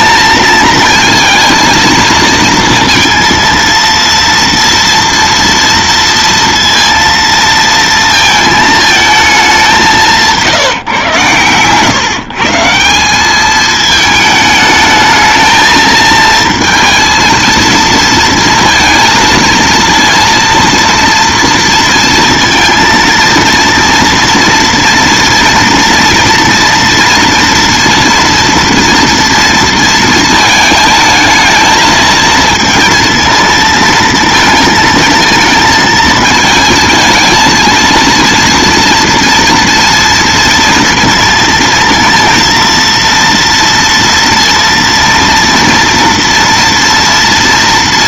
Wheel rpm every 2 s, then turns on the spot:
220, 230, 230, 230, 220, 150, 160, 220, 230, 230, 230, 230, 230, 230, 230, 220, 230, 230, 220, 230, 230, 230, 230, 230.
none